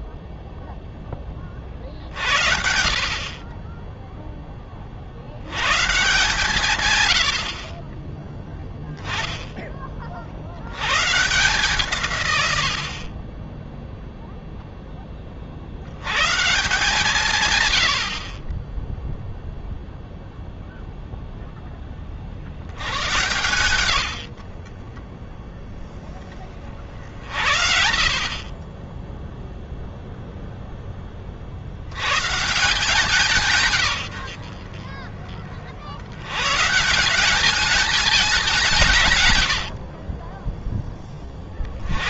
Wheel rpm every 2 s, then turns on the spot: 10, 60, 20, 140, 10, 110, 60, 10, 160, 10, 0, 90, 40, 50, 20, 10, 160, 40, 150, 170, 30.
none